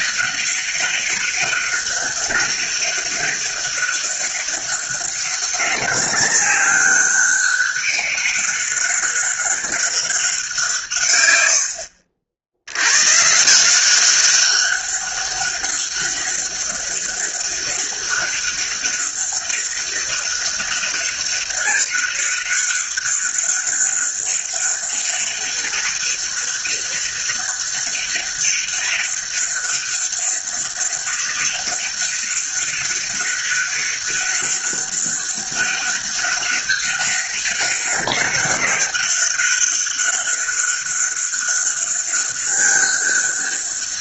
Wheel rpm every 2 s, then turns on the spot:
200, 200, 200, 190, 200, 150, 100, 200, 200, 200, 200, 200, 200, 200, 200, 200, 190, 200, 200, 200, 200, 200.
none